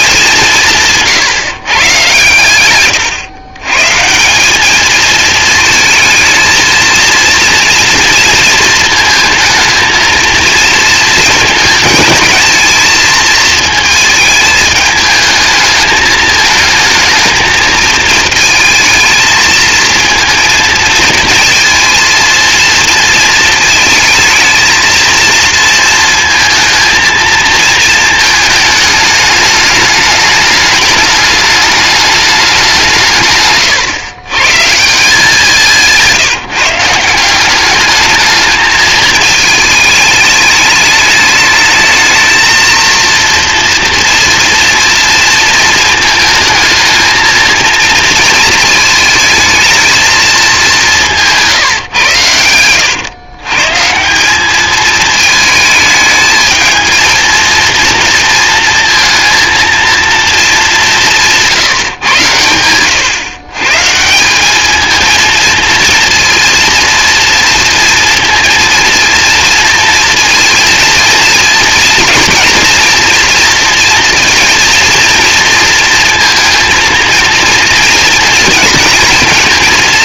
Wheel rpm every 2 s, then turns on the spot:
170, 120, 210, 220, 230, 220, 220, 220, 220, 220, 220, 230, 230, 230, 210, 210, 190, 150, 170, 220, 210, 230, 230, 230, 220, 200, 110, 220, 220, 230, 200, 100, 220, 230, 230, 220, 230, 230, 230, 230.
0-4